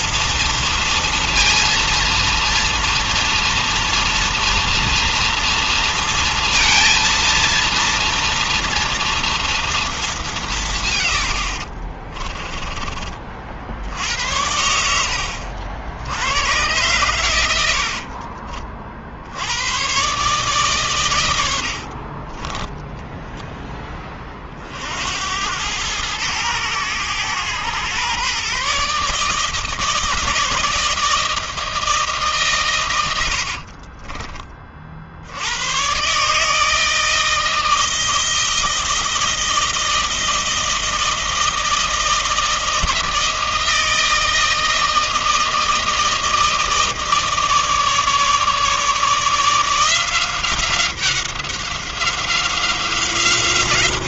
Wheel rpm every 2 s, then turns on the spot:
230, 230, 230, 230, 230, 200, 40, 70, 100, 50, 130, 40, 40, 100, 130, 160, 150, 30, 140, 160, 160, 160, 160, 160, 150, 180, 180.
12-14 18-20 22-24